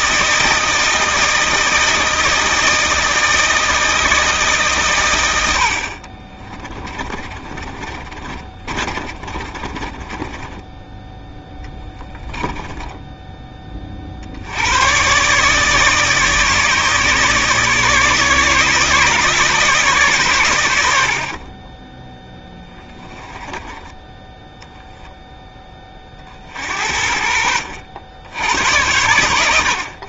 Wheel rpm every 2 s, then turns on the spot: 160, 160, 120, 30, 30, 10, 10, 110, 150, 150, 80, 10, 0, 60, 90.
6-10 12-14 22-24